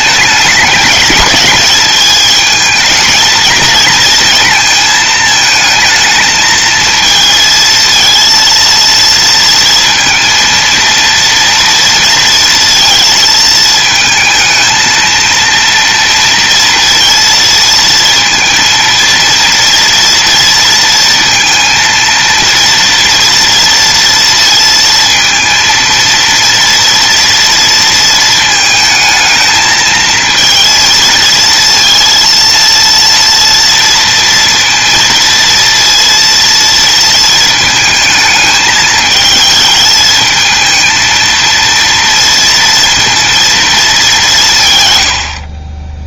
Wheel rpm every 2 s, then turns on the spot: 210, 220, 220, 220, 230, 230, 230, 230, 230, 230, 230, 230, 230, 230, 220, 230, 230, 230, 230, 220, 230, 230, 90.
none